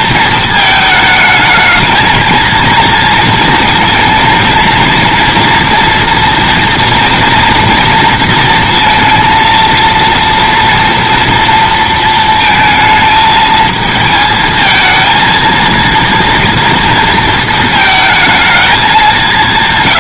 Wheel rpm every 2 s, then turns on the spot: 220, 230, 230, 230, 230, 230, 220, 220, 230, 210.
none